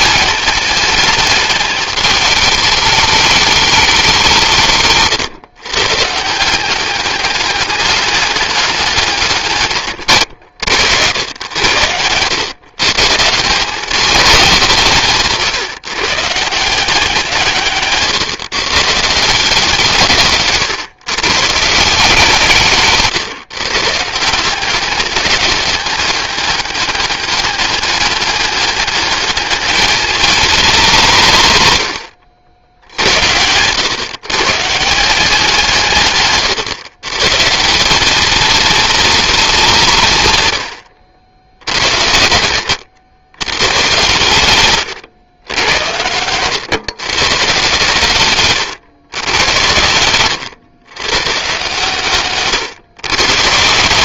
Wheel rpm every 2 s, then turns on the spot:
220, 210, 140, 200, 140, 100, 170, 150, 160, 170, 150, 150, 200, 200, 210, 140, 100, 170, 170, 210, 90, 140, 110, 130, 110, 140, 160.
48-50